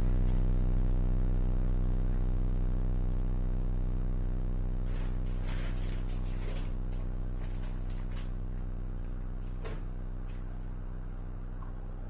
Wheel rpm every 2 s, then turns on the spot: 0, 0, 0, 0, 0, 0.
none